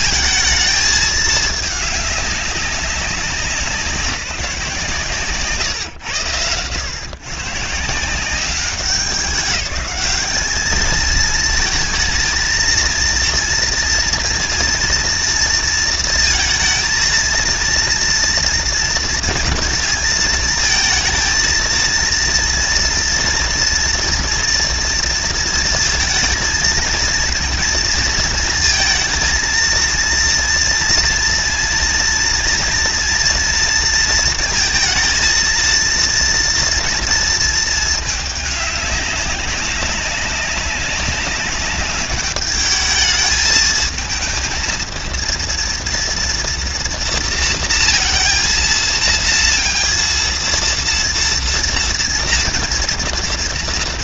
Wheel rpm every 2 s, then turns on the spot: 220, 200, 170, 110, 190, 210, 230, 230, 220, 230, 220, 230, 240, 230, 230, 230, 230, 230, 230, 210, 190, 210, 230, 230, 230, 230, 230.
none